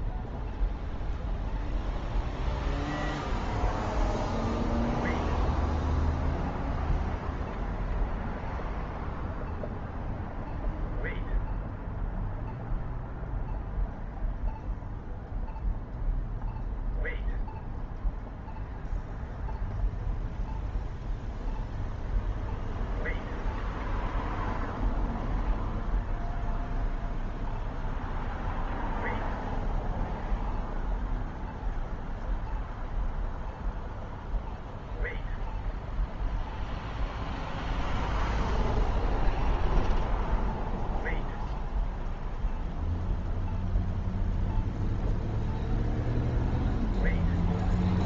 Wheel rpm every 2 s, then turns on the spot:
0, 0, 0, 0, 0, 0, 0, 0, 0, 0, 0, 0, 0, 0, 0, 0, 0, 0, 0, 0, 0, 0, 0, 0.
none